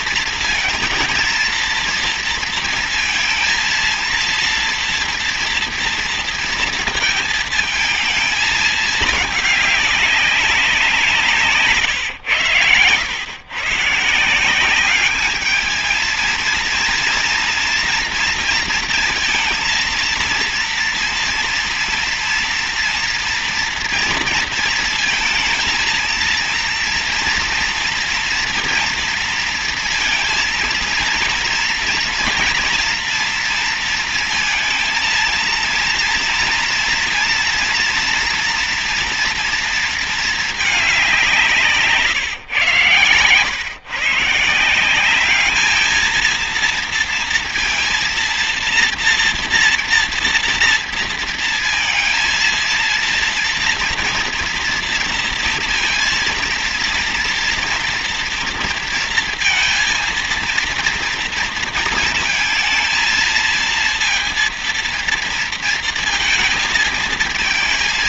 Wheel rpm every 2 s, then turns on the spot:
230, 230, 230, 230, 220, 190, 110, 180, 230, 230, 230, 230, 230, 230, 230, 230, 240, 230, 230, 230, 210, 130, 160, 230, 230, 230, 230, 230, 230, 230, 230, 220, 230, 220.
none